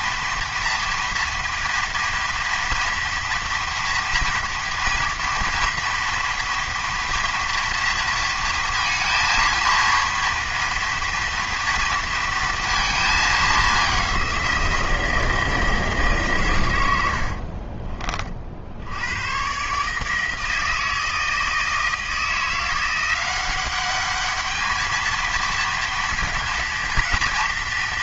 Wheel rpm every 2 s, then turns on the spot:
240, 230, 230, 230, 230, 230, 230, 170, 110, 80, 160, 170, 220, 230.
none